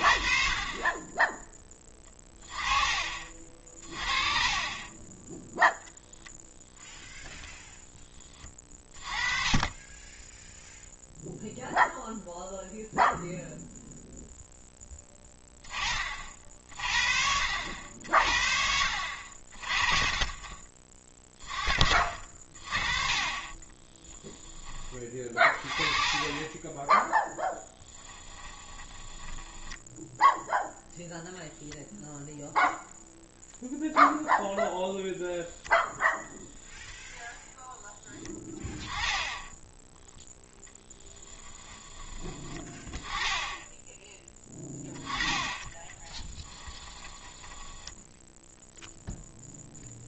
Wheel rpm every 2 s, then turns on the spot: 30, 30, 20, 10, 30, 0, 0, 10, 50, 50, 40, 40, 20, 10, 20, 0, 0, 0, 0, 20, 10, 10, 10, 20, 0.
28-30 40-42 46-48